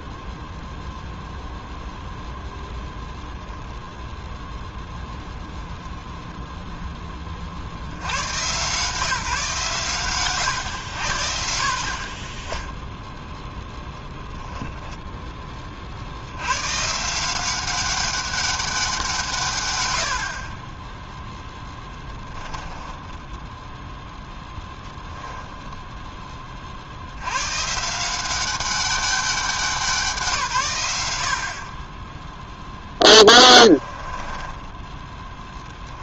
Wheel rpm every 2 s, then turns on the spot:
0, 0, 0, 100, 130, 30, 10, 50, 190, 80, 10, 0, 10, 170, 180, 20, 20, 20.
12-14 20-22 32-36